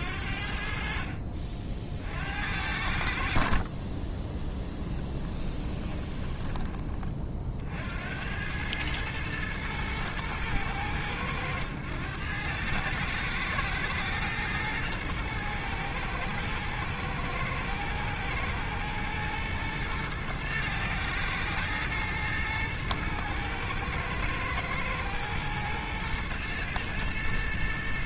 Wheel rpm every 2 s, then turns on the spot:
50, 70, 10, 30, 110, 100, 110, 110, 110, 110, 110, 110, 110, 110.
4-6